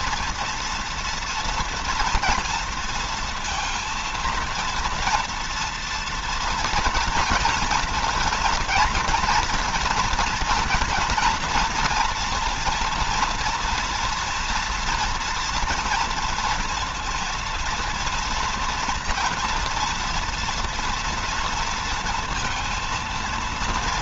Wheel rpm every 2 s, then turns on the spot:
230, 230, 230, 230, 230, 240, 230, 230, 230, 240, 230, 230.
none